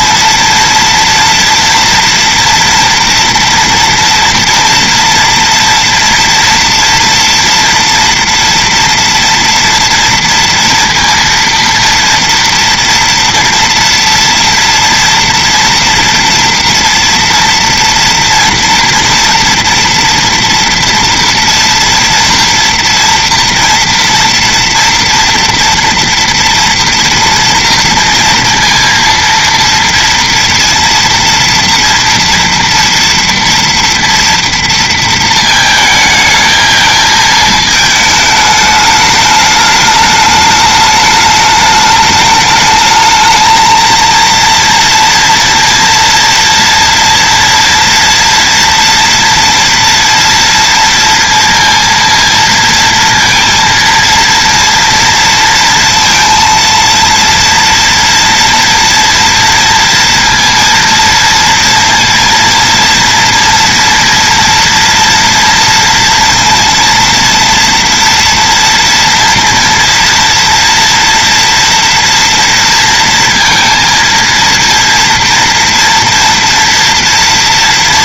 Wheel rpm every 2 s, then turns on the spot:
230, 230, 230, 230, 230, 230, 230, 230, 230, 240, 230, 240, 230, 230, 230, 230, 240, 240, 220, 210, 210, 210, 230, 230, 230, 230, 230, 230, 230, 230, 230, 230, 230, 230, 230, 230, 230, 230, 230.
none